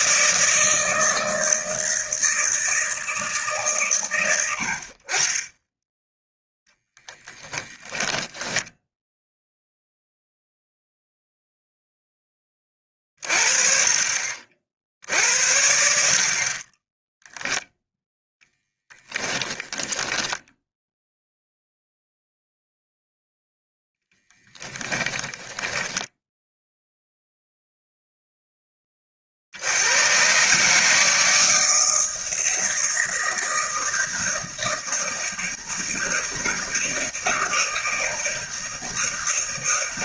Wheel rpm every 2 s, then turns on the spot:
160, 160, 60, 10, 10, 0, 30, 60, 20, 10, 0, 0, 10, 0, 20, 150, 160, 160, 160, 160.
18-20 24-26